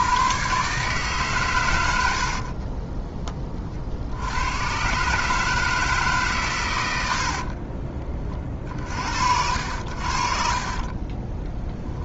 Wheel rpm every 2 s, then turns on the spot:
130, 40, 110, 110, 40, 40.
2-4